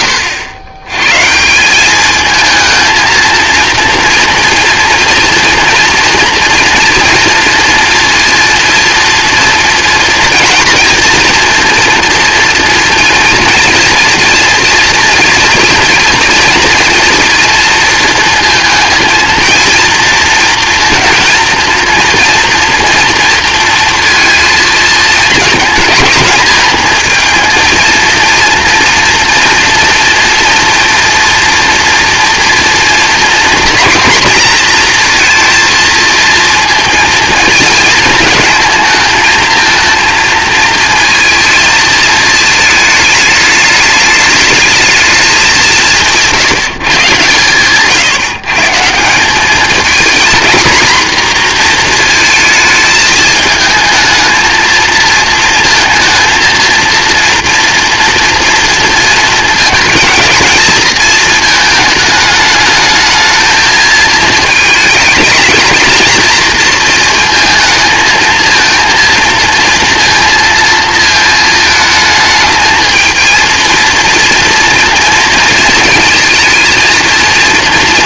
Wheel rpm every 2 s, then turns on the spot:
110, 230, 230, 230, 230, 230, 230, 230, 230, 230, 230, 230, 220, 230, 230, 240, 230, 230, 230, 220, 230, 210, 210, 150, 170, 240, 220, 230, 230, 230, 220, 220, 220, 230, 230, 220, 220, 230, 230.
none